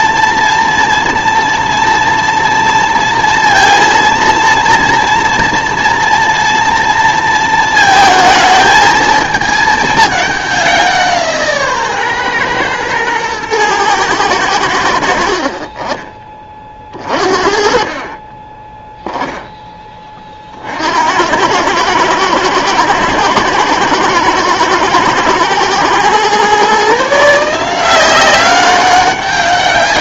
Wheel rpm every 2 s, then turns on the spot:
230, 230, 230, 230, 220, 190, 120, 80, 30, 10, 60, 110, 110, 140, 190.
16-20